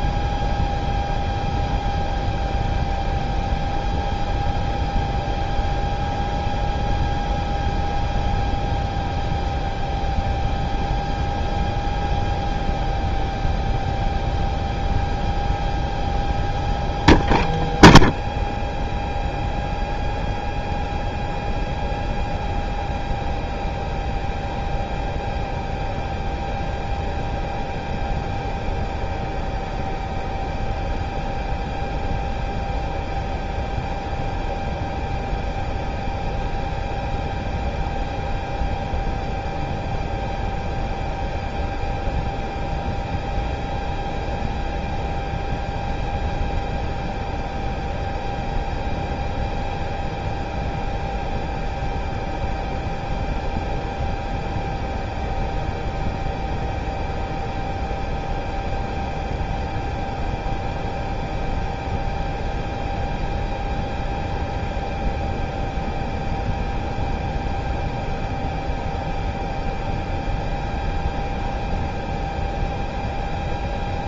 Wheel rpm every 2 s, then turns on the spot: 0, 0, 0, 0, 0, 0, 0, 0, 0, 0, 0, 0, 0, 0, 0, 0, 0, 0, 0, 0, 0, 0, 0, 0, 0, 0, 0, 0, 0, 0, 0, 0, 0, 0, 0, 0, 0.
none